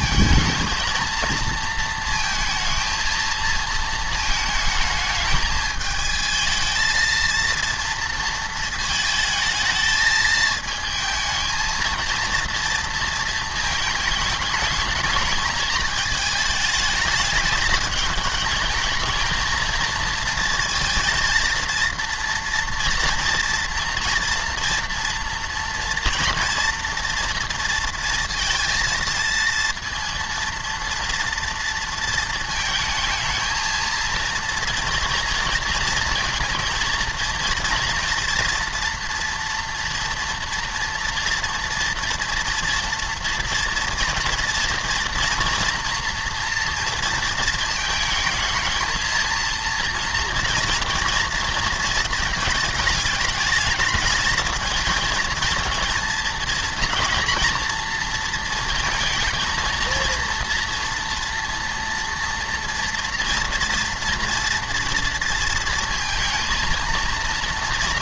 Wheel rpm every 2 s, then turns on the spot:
220, 230, 220, 220, 220, 220, 230, 220, 220, 220, 230, 230, 240, 240, 230, 230, 220, 230, 220, 240, 230, 230, 240, 230, 220, 240, 220, 230, 230, 230, 230, 240, 230, 230.
none